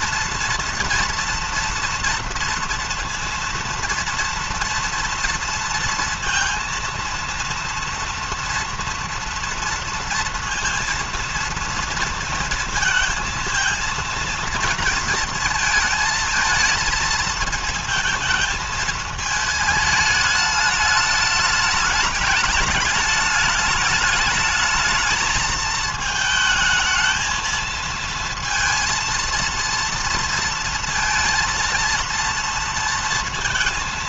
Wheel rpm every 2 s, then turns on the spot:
230, 230, 230, 230, 240, 230, 220, 230, 220, 220, 210, 210, 210, 220, 230, 230, 230.
none